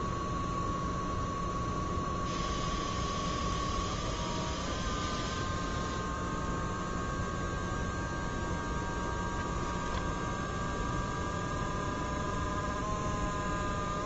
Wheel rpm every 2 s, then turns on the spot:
0, 0, 0, 0, 0, 0, 0.
none